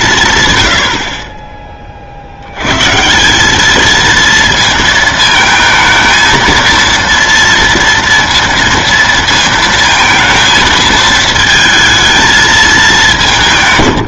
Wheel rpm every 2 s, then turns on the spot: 150, 50, 230, 230, 230, 230, 220.
none